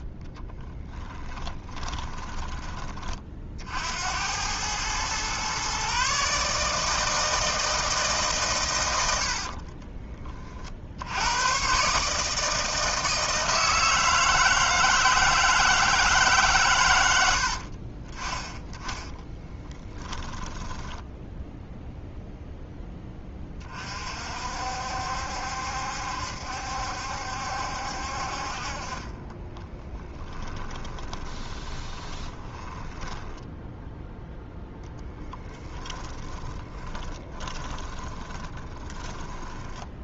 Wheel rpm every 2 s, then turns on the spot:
10, 20, 110, 150, 110, 60, 160, 160, 120, 10, 10, 10, 60, 70, 40, 20, 10, 20, 20, 10.
0-2 20-22 30-40